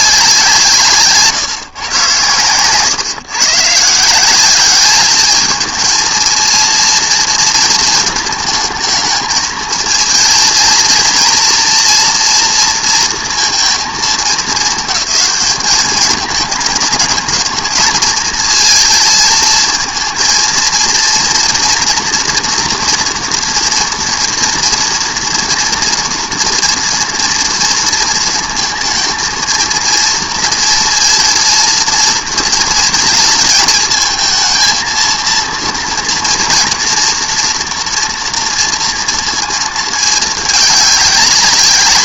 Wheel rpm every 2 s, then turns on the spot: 170, 130, 200, 230, 220, 230, 230, 220, 220, 220, 230, 240, 230, 230, 220, 230, 230, 230, 230, 230, 210.
2-4